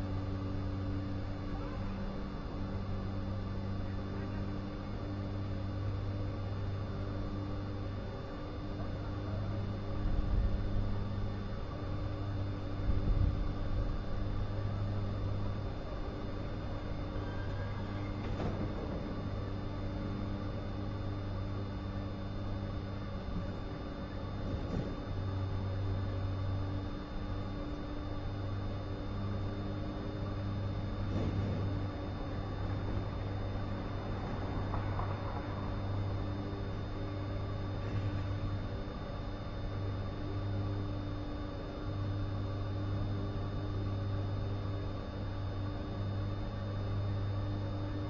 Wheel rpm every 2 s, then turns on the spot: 0, 0, 0, 0, 0, 0, 0, 0, 0, 0, 0, 0, 0, 0, 0, 0, 0, 0, 0, 0, 0, 0, 0, 0.
none